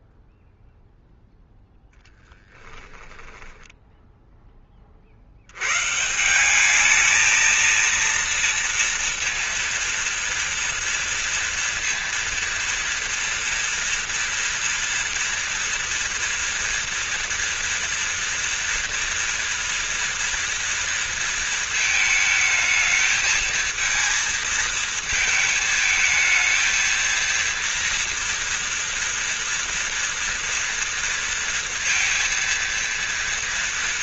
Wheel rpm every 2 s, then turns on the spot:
0, 10, 10, 170, 230, 230, 230, 230, 240, 230, 230, 220, 230, 220, 230, 230, 230.
2-6